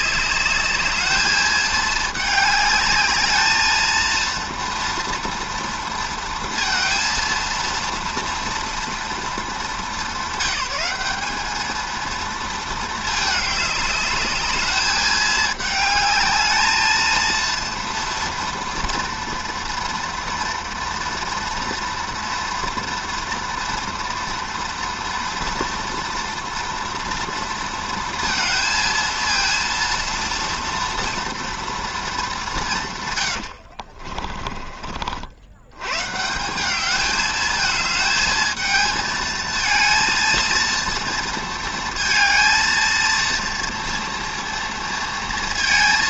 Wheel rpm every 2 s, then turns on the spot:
220, 210, 230, 230, 230, 200, 220, 210, 230, 230, 230, 230, 230, 230, 230, 230, 130, 60, 210, 220, 230, 230, 230.
32-34